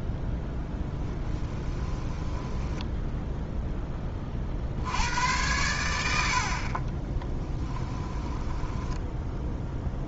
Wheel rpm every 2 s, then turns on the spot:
10, 10, 70, 40, 10.
0-4 8-10